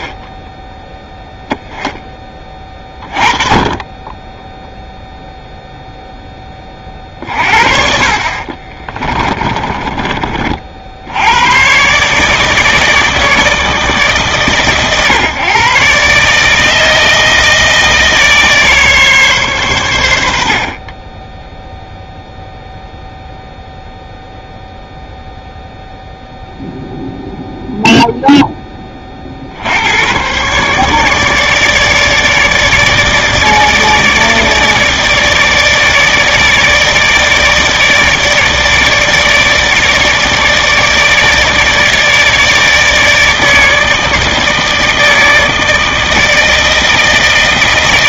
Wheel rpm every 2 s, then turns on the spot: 0, 30, 0, 30, 40, 60, 160, 120, 160, 150, 40, 0, 0, 0, 20, 140, 150, 150, 150, 150, 150, 160, 160, 160.
8-10